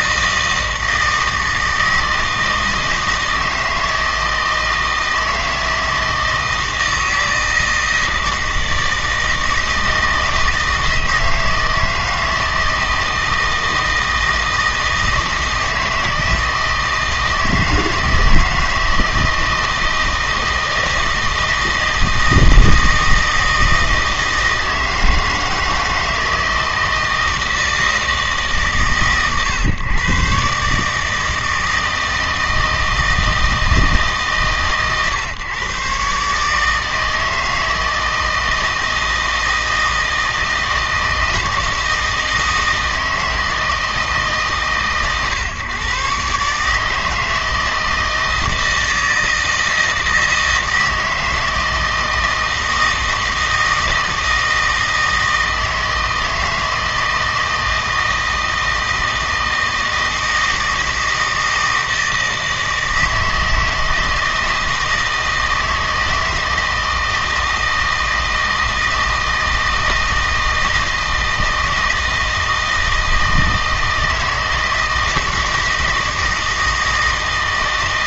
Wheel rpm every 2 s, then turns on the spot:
160, 160, 160, 160, 160, 160, 160, 160, 160, 160, 160, 160, 160, 160, 140, 150, 160, 120, 150, 160, 160, 160, 140, 150, 160, 160, 160, 160, 160, 160, 160, 160, 160, 160, 160, 160, 160, 160, 160.
none